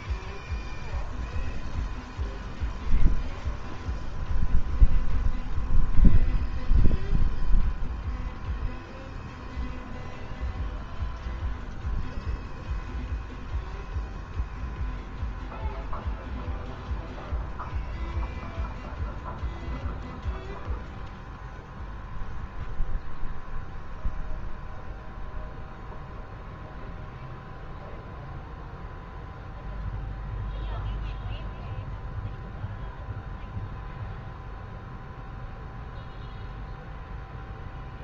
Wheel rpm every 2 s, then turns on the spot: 0, 0, 0, 0, 0, 0, 0, 0, 0, 0, 0, 0, 0, 0, 0, 0, 0, 0, 0.
none